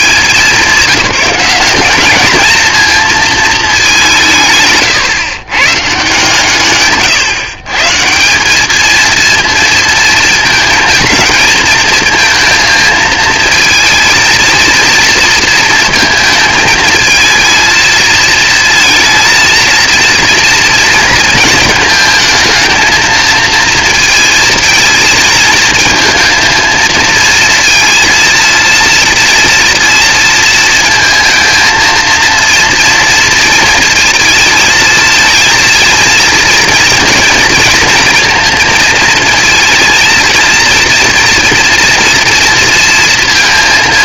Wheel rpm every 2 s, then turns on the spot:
200, 220, 130, 140, 210, 220, 230, 230, 220, 230, 230, 220, 230, 230, 230, 230, 230, 220, 230, 230, 230, 230.
none